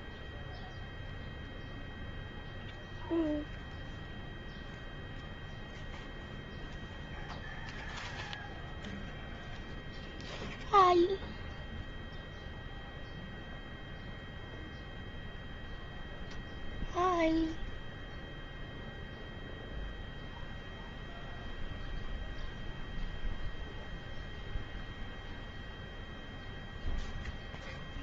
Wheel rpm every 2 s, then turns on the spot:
0, 0, 0, 0, 0, 0, 0, 0, 0, 0, 0, 0, 0, 0.
none